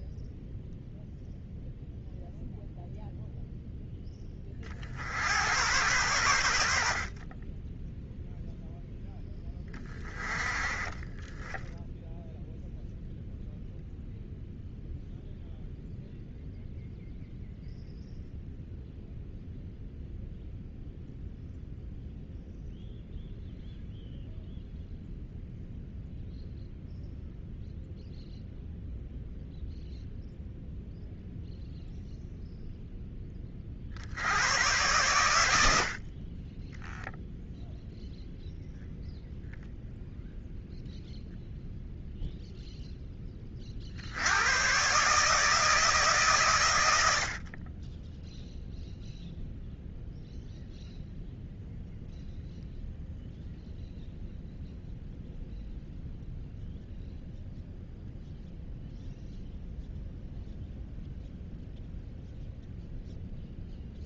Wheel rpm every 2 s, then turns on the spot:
0, 0, 30, 80, 0, 20, 0, 0, 0, 0, 0, 0, 0, 0, 0, 0, 0, 90, 30, 0, 0, 0, 110, 120, 0, 0, 0, 0, 0, 0, 0, 0.
36-38